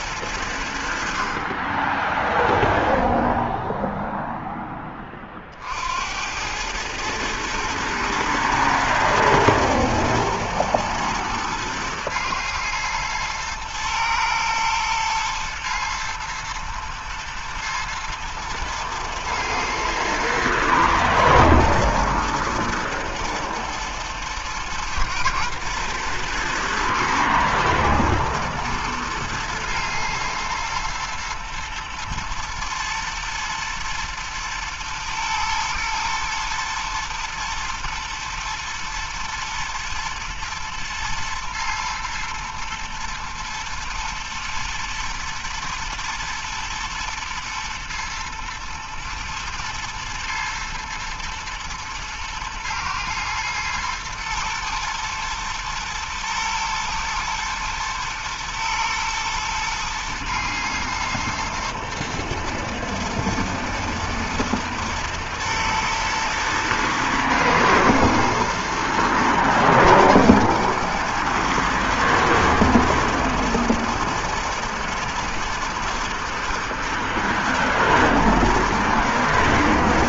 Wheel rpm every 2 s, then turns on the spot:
40, 0, 30, 110, 110, 110, 110, 120, 110, 110, 110, 120, 110, 120, 120, 120, 120, 120, 110, 120, 120, 110, 110, 120, 120, 110, 110, 110, 110, 110, 110, 110, 110, 120, 110, 120, 120, 120, 110, 120.
none